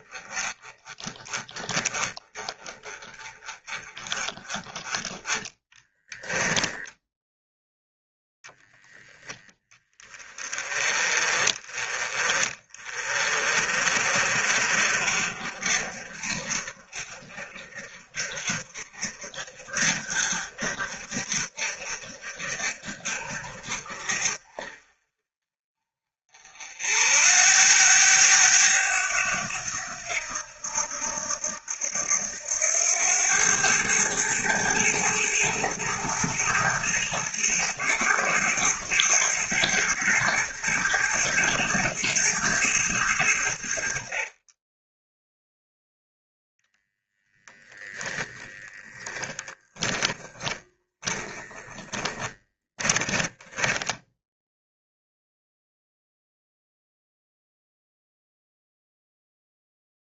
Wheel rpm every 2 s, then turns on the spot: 20, 20, 40, 10, 10, 30, 30, 40, 40, 40, 40, 40, 40, 60, 100, 80, 90, 110, 110, 110, 110, 100, 10, 0, 10, 30, 10, 0, 0, 0.
6-8 50-52